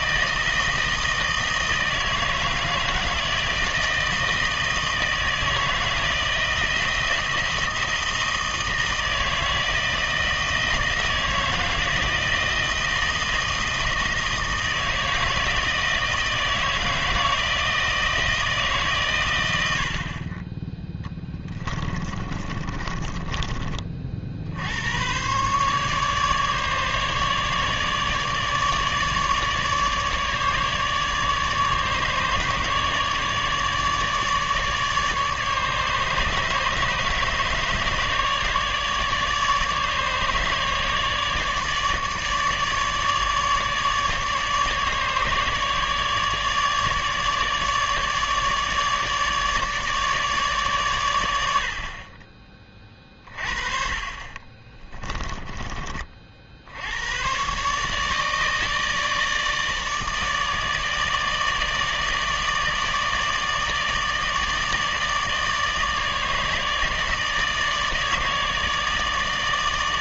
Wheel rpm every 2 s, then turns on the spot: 160, 160, 160, 160, 160, 160, 160, 160, 160, 150, 10, 30, 80, 150, 150, 150, 150, 150, 150, 150, 150, 150, 150, 150, 150, 130, 30, 30, 70, 160, 160, 150, 150, 150, 160.
22-24 54-56